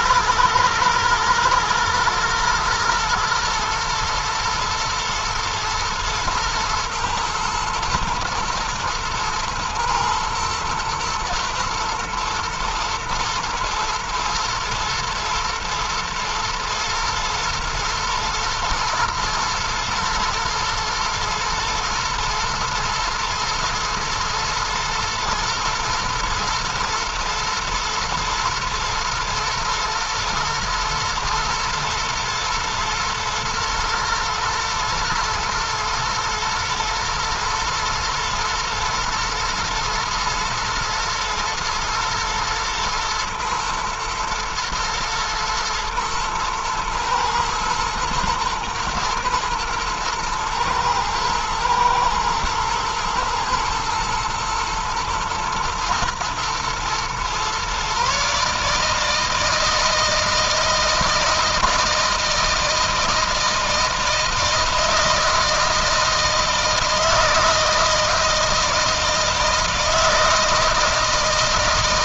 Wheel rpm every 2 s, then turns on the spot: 110, 110, 120, 110, 110, 120, 120, 110, 120, 120, 120, 120, 120, 110, 110, 120, 120, 110, 120, 110, 110, 110, 120, 110, 120, 110, 110, 110, 120, 150, 160, 160, 160, 160, 160, 160.
none